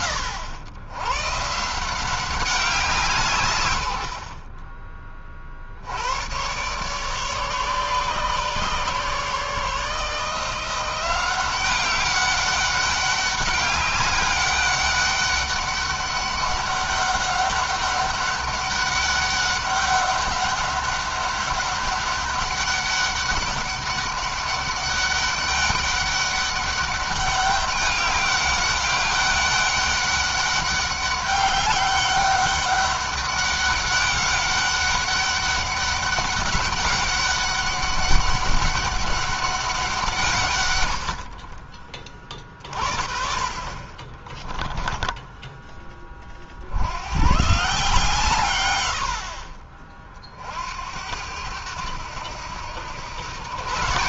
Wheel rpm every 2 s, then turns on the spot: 120, 170, 40, 130, 140, 170, 200, 200, 200, 200, 200, 200, 200, 200, 200, 200, 200, 200, 200, 200, 120, 40, 10, 90, 130, 60, 90.
44-46